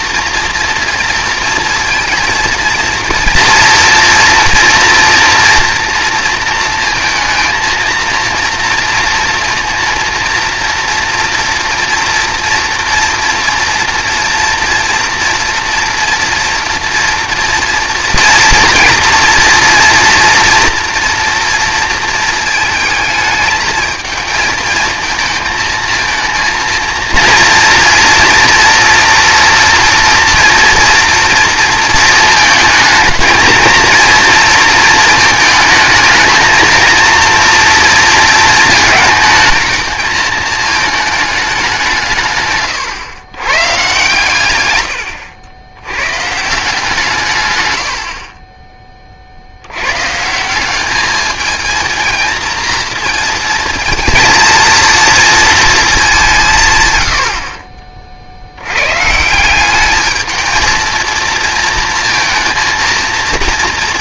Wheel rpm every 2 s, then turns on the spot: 230, 230, 230, 230, 230, 230, 230, 240, 230, 240, 230, 220, 220, 230, 230, 230, 220, 230, 230, 220, 220, 130, 110, 160, 20, 190, 230, 230, 150, 90, 220, 230.
44-46